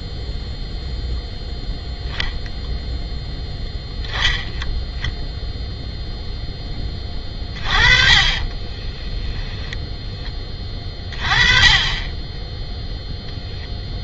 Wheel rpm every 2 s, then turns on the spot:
0, 0, 10, 10, 30, 20, 0.
8-10